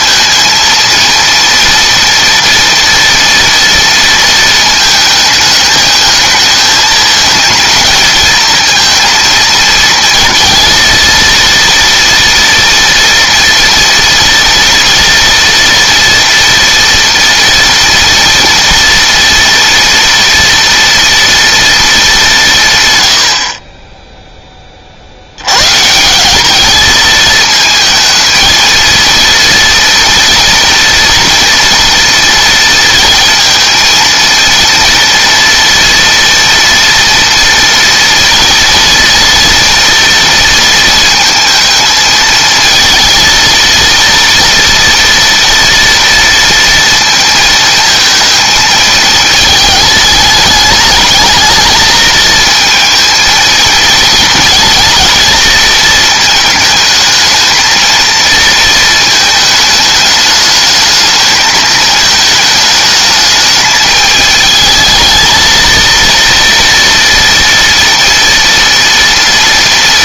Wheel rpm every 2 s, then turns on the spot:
230, 230, 220, 220, 220, 230, 230, 230, 230, 230, 230, 150, 30, 210, 230, 240, 230, 230, 230, 240, 230, 230, 230, 230, 220, 220, 220, 230, 220, 220, 210, 220, 220, 230, 230.
none